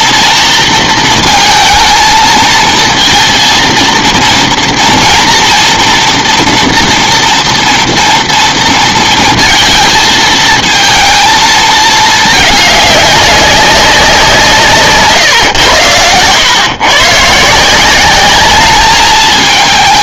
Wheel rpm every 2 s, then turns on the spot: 230, 230, 230, 230, 230, 220, 210, 150, 110, 210.
none